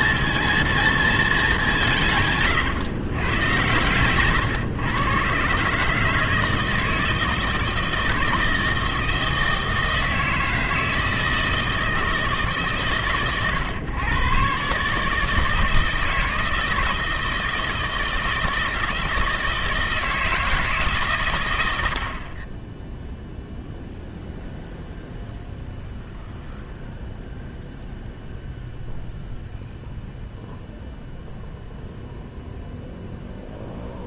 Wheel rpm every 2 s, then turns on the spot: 230, 130, 120, 160, 160, 160, 130, 140, 160, 160, 150, 10, 0, 0, 0, 0, 0.
none